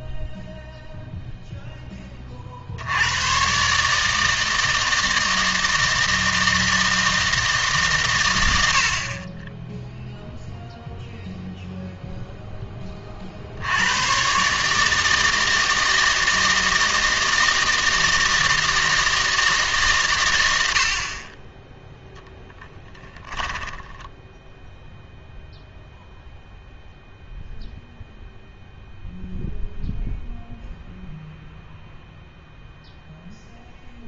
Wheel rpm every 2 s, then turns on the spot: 0, 60, 160, 160, 80, 0, 10, 150, 160, 160, 70, 10, 0, 0, 0, 0, 0.
22-24